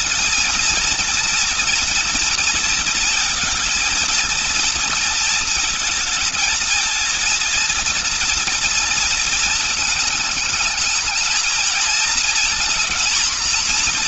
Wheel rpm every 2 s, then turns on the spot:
230, 230, 240, 230, 230, 220, 230.
none